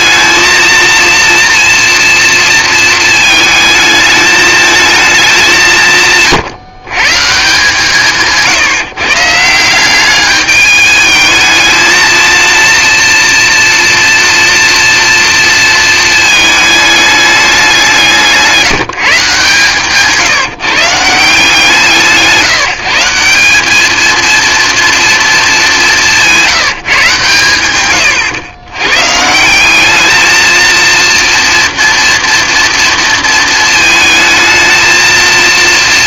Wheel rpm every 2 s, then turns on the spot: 230, 220, 220, 140, 150, 210, 230, 230, 210, 180, 160, 170, 230, 170, 120, 230, 230, 220.
none